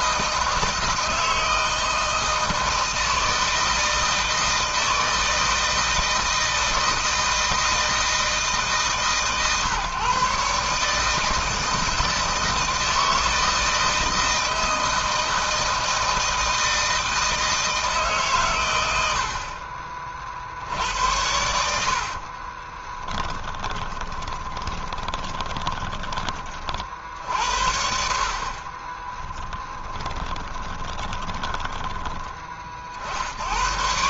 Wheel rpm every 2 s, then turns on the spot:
160, 160, 160, 160, 150, 150, 160, 160, 160, 100, 90, 10, 10, 50, 20, 20, 50.
22-26 28-32